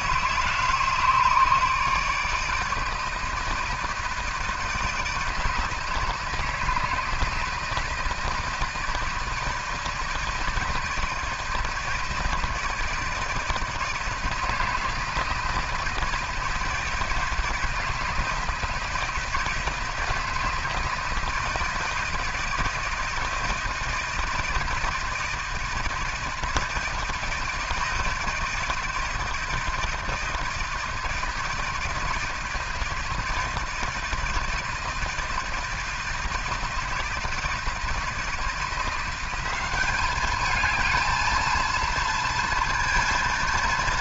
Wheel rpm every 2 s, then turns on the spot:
150, 160, 160, 160, 160, 160, 160, 160, 160, 160, 160, 160, 160, 160, 160, 160, 160, 160, 160, 170, 220, 230.
none